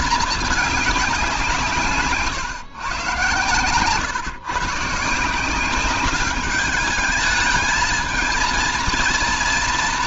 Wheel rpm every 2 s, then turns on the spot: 210, 130, 140, 210, 230.
none